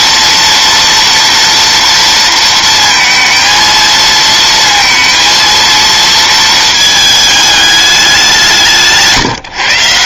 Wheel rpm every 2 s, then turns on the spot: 230, 220, 230, 220, 160.
none